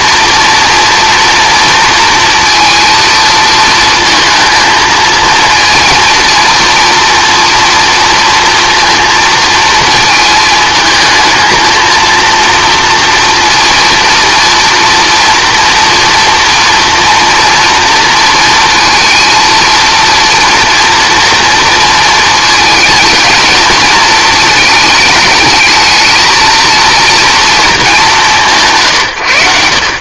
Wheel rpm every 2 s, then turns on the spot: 230, 230, 220, 230, 230, 220, 230, 240, 230, 230, 230, 220, 220, 230, 150.
none